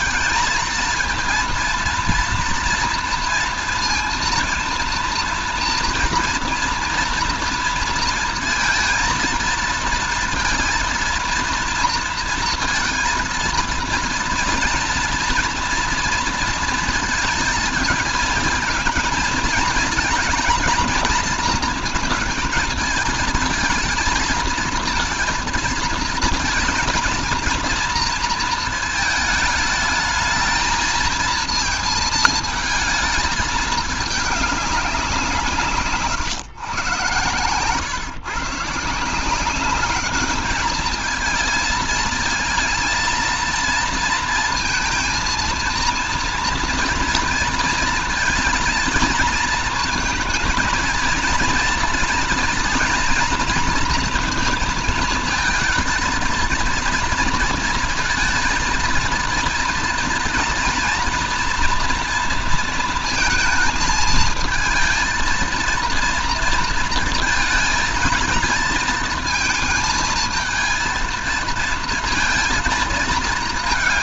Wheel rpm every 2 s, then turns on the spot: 220, 230, 230, 240, 230, 230, 230, 230, 230, 220, 220, 220, 230, 230, 220, 220, 220, 200, 120, 140, 210, 220, 230, 240, 230, 230, 240, 230, 230, 230, 240, 230, 220, 230, 220, 230, 230.
none